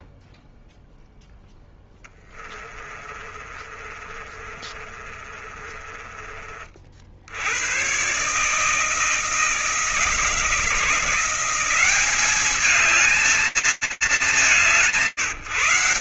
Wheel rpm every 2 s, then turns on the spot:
0, 30, 30, 50, 150, 170, 210, 180.
2-6